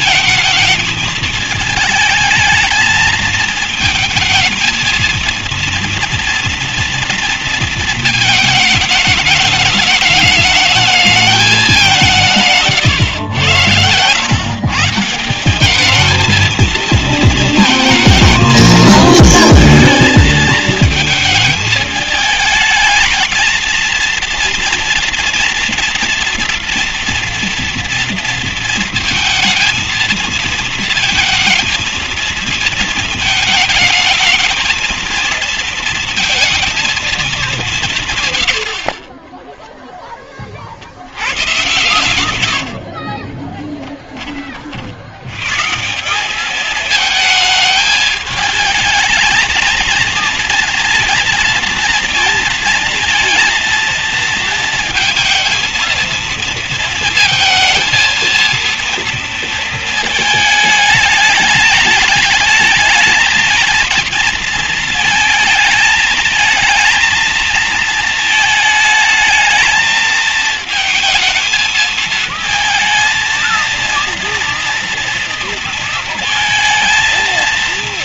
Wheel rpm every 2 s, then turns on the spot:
220, 220, 220, 230, 220, 210, 180, 120, 210, 220, 220, 220, 230, 230, 230, 230, 230, 220, 220, 160, 10, 120, 20, 160, 220, 230, 230, 230, 230, 220, 230, 210, 230, 220, 220, 220, 220, 230, 230.
none